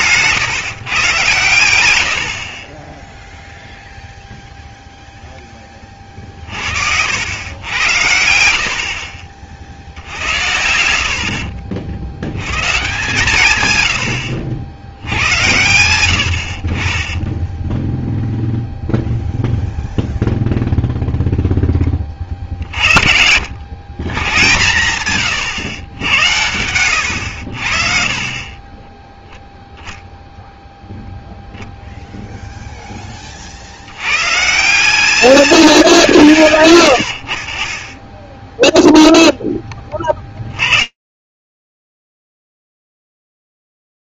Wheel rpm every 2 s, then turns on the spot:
140, 50, 0, 50, 80, 70, 110, 80, 70, 0, 0, 40, 130, 100, 30, 0, 0, 140, 130, 10, 30, 0.
0-2 14-16 36-38